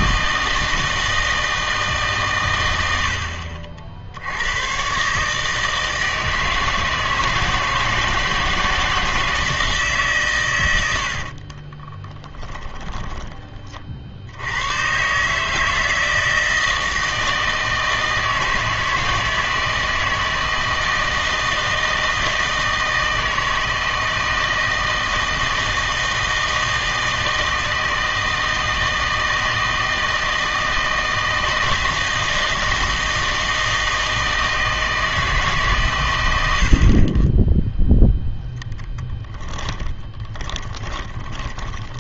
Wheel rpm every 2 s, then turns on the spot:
160, 90, 110, 160, 160, 90, 20, 100, 160, 160, 160, 160, 160, 160, 160, 160, 160, 160, 70, 0, 20.
12-14 40-42